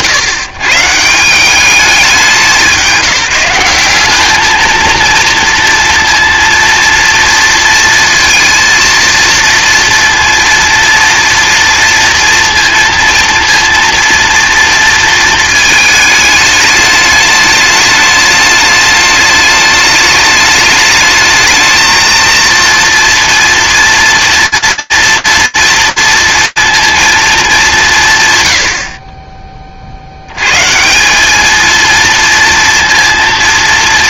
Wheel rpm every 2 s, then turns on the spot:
130, 180, 220, 230, 230, 240, 230, 230, 210, 210, 210, 230, 230, 230, 100, 140, 230.
none